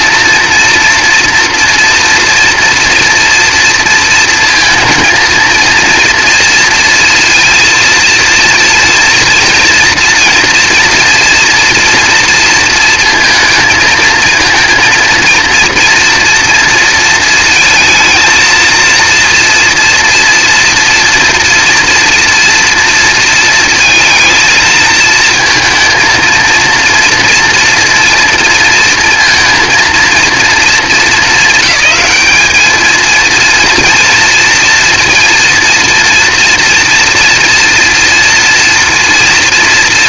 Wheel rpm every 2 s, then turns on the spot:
230, 240, 230, 230, 230, 240, 230, 230, 230, 230, 230, 230, 230, 230, 230, 220, 210, 230, 230, 230.
none